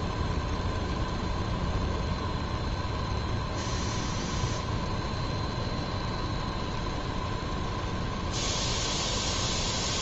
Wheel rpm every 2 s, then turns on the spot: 0, 0, 0, 0, 0.
none